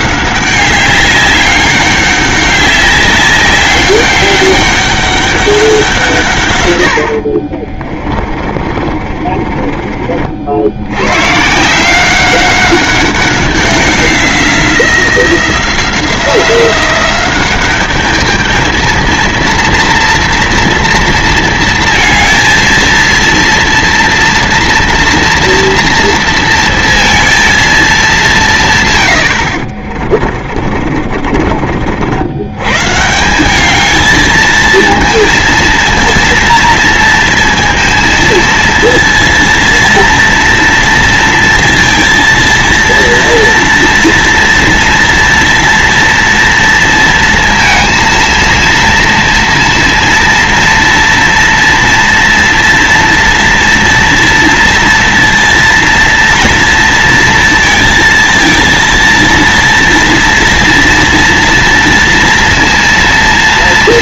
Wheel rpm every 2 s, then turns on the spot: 190, 200, 200, 120, 30, 70, 190, 180, 180, 220, 230, 230, 230, 230, 150, 40, 130, 220, 230, 230, 230, 230, 230, 230, 230, 230, 230, 230, 240, 230, 230, 230.
8-10 30-32